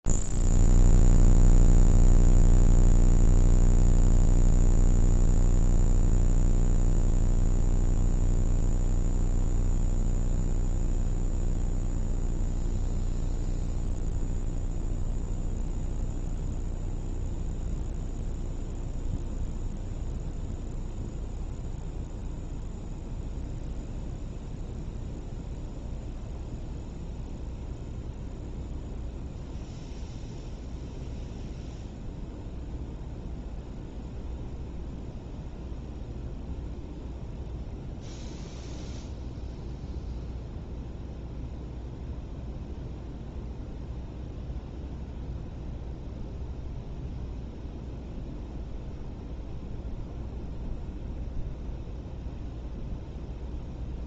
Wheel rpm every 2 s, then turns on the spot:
0, 0, 0, 0, 0, 0, 0, 0, 0, 0, 0, 0, 0, 0, 0, 0, 0, 0, 0, 0, 0, 0, 0, 0, 0, 0, 0.
none